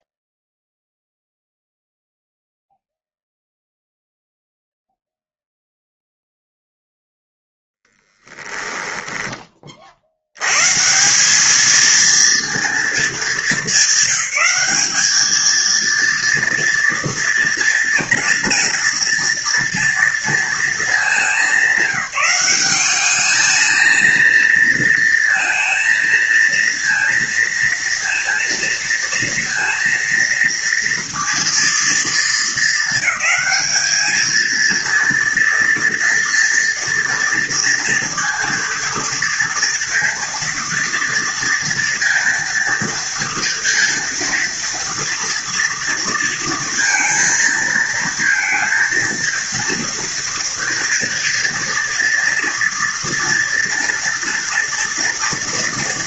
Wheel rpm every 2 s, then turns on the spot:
0, 0, 0, 0, 10, 100, 230, 200, 230, 240, 230, 190, 230, 230, 230, 230, 220, 220, 230, 230, 230, 230, 230, 230, 230, 230, 230, 230.
8-10